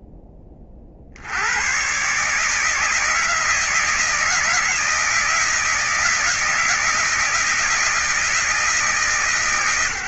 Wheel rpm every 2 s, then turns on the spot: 20, 150, 160, 160, 160.
none